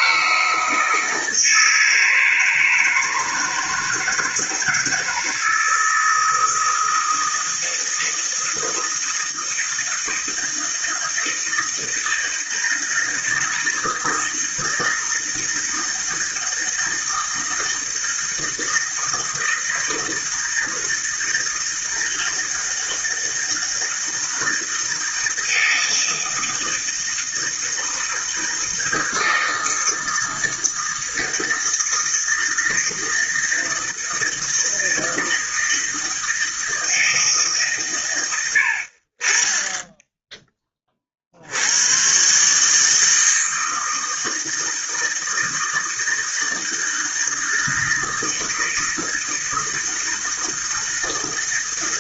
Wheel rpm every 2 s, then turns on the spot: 160, 160, 160, 160, 160, 160, 160, 160, 160, 160, 160, 160, 160, 160, 160, 160, 160, 160, 160, 60, 20, 150, 160, 160, 160, 160.
none